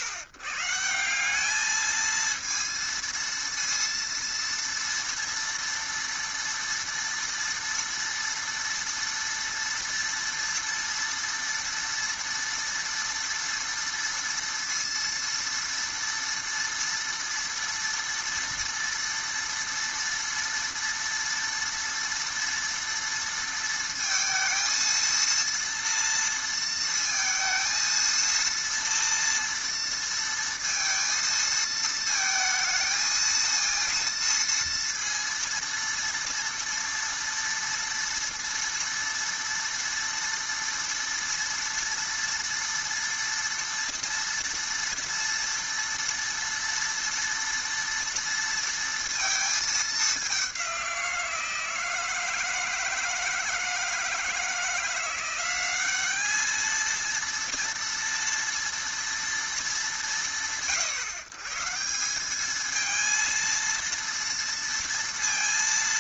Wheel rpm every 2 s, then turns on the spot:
130, 230, 230, 230, 230, 230, 240, 230, 230, 230, 230, 230, 230, 230, 230, 230, 220, 230, 230, 230, 230, 230, 240, 230, 230, 190, 160, 160, 220, 230, 110, 210, 230.
none